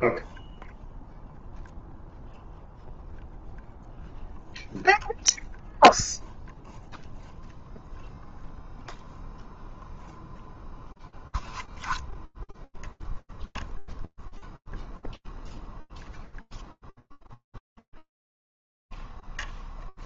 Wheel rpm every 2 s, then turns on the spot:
0, 0, 0, 0, 0, 0, 0, 0, 0, 0.
none